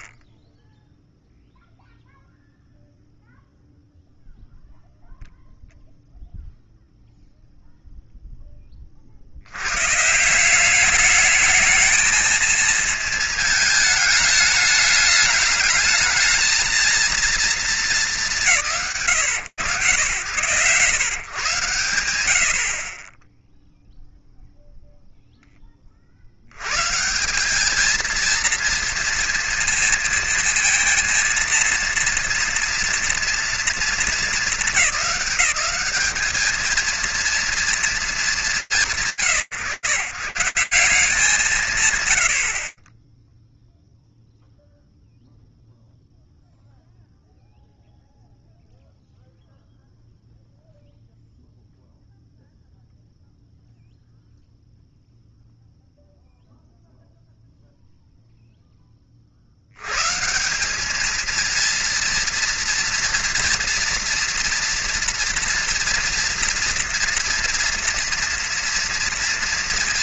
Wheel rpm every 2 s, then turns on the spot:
70, 0, 0, 0, 10, 180, 220, 220, 220, 130, 120, 90, 0, 90, 230, 220, 230, 210, 220, 200, 140, 100, 0, 0, 0, 0, 0, 0, 0, 40, 220, 230, 230, 230, 230.
none